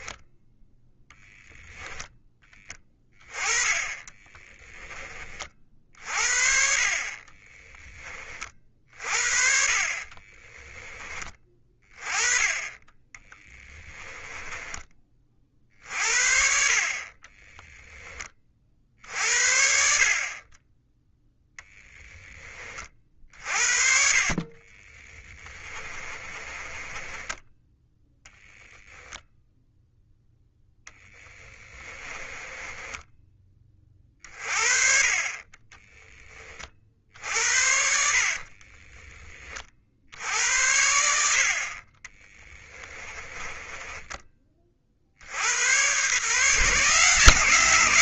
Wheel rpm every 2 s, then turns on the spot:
10, 20, 10, 40, 40, 10, 20, 20, 40, 50, 10, 30, 20, 20, 10, 10, 20, 40, 50, 30, 70, 30, 50, 150.
24-34 38-40 42-44